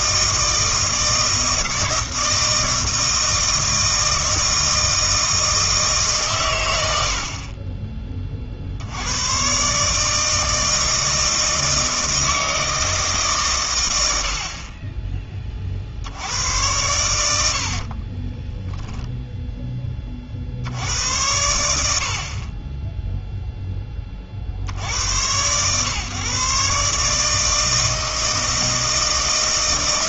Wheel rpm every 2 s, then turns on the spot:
160, 160, 160, 100, 60, 160, 160, 50, 90, 10, 60, 20, 70, 140, 160.
18-20